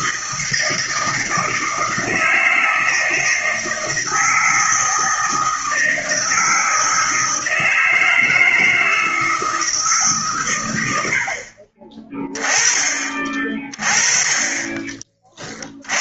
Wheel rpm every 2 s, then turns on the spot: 160, 160, 160, 160, 160, 100, 20, 30.
none